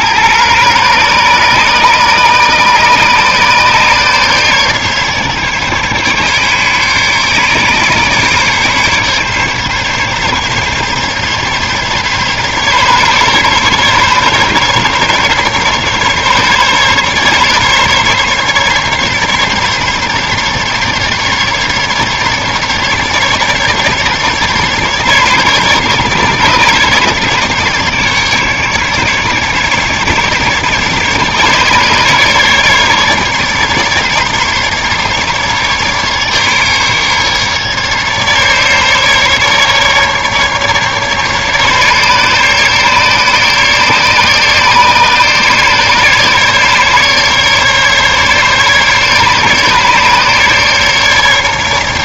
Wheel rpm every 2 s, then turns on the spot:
100, 140, 140, 140, 140, 140, 140, 140, 140, 140, 140, 140, 140, 140, 140, 140, 150, 150, 150, 150, 150, 140, 150, 150, 140, 140.
none